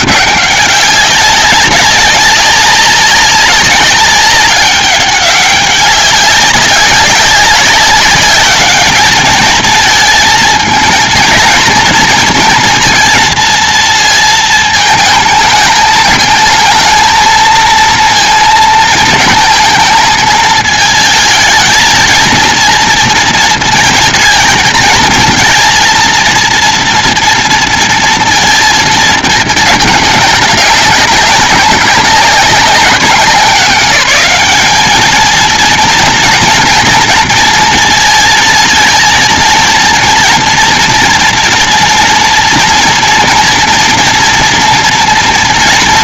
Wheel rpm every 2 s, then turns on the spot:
190, 200, 200, 200, 200, 230, 230, 220, 220, 230, 220, 230, 220, 230, 230, 210, 190, 200, 230, 220, 230, 240, 230.
none